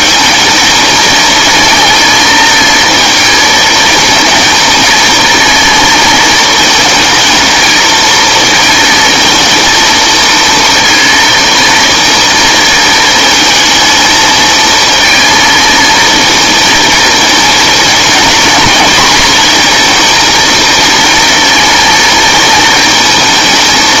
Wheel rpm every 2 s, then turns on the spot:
220, 220, 220, 220, 220, 230, 230, 230, 230, 230, 230, 230.
none